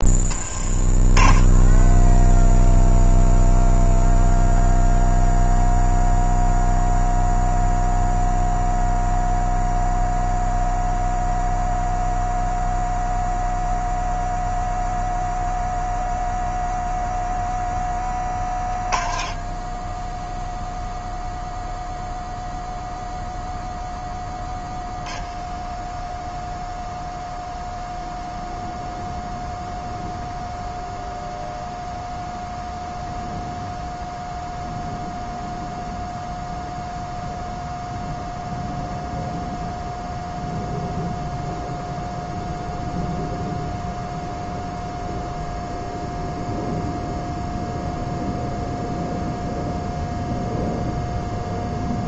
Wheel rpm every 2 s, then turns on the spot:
20, 0, 0, 0, 0, 0, 0, 0, 0, 20, 0, 0, 10, 10, 0, 0, 0, 0, 0, 0, 0, 0, 0, 0, 0, 0.
none